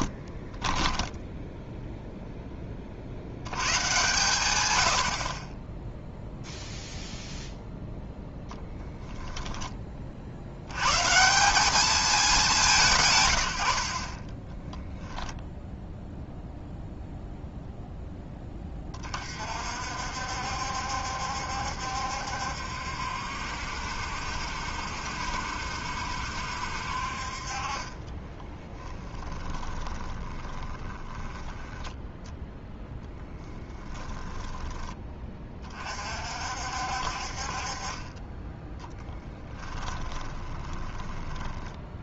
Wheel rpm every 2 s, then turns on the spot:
10, 40, 100, 0, 10, 110, 150, 10, 0, 20, 70, 70, 60, 60, 10, 20, 0, 20, 60, 10, 20.
0-2 28-32 38-42